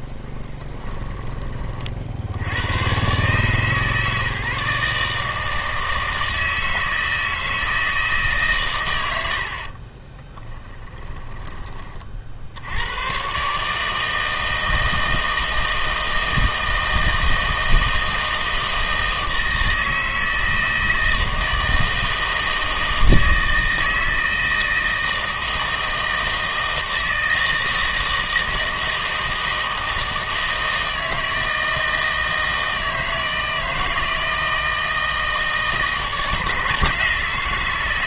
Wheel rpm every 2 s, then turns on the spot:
10, 90, 150, 160, 120, 10, 70, 160, 160, 160, 160, 160, 160, 160, 160, 160, 160, 160, 160.
0-2 10-12